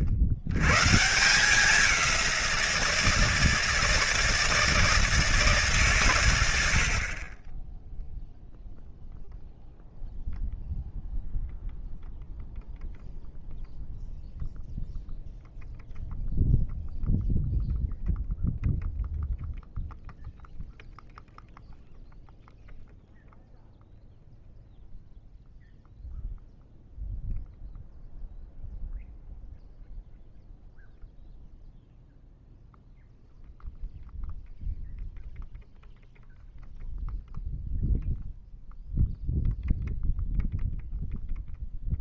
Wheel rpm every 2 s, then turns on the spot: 140, 170, 160, 80, 0, 0, 0, 0, 0, 0, 0, 0, 0, 0, 0, 0, 0, 0, 0, 0, 0.
none